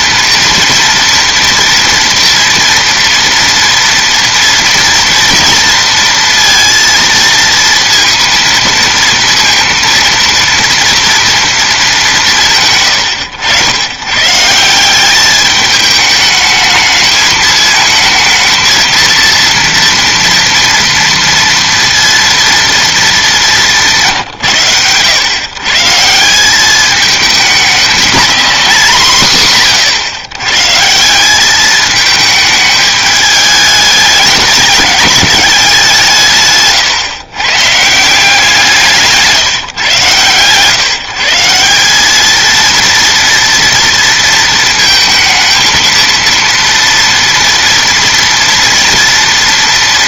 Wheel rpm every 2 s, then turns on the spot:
240, 230, 230, 230, 230, 230, 160, 150, 210, 220, 240, 230, 150, 180, 210, 120, 210, 210, 150, 180, 130, 220, 230, 230, 230.
none